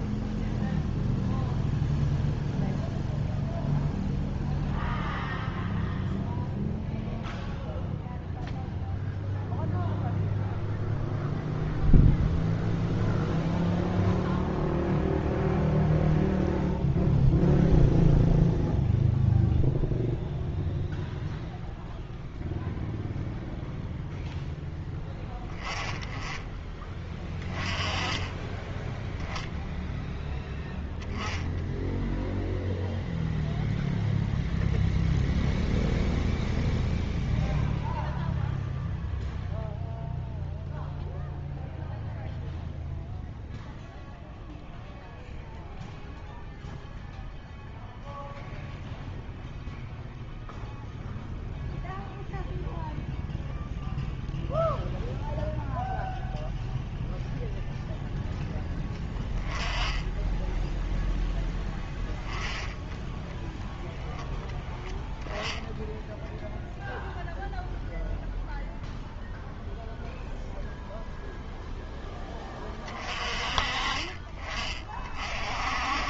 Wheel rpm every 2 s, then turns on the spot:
0, 0, 0, 0, 0, 0, 0, 0, 0, 0, 0, 0, 10, 10, 10, 0, 0, 0, 0, 0, 0, 0, 0, 0, 0, 0, 0, 0, 0, 10, 10, 10, 0, 0, 0, 0, 20, 30.
28-30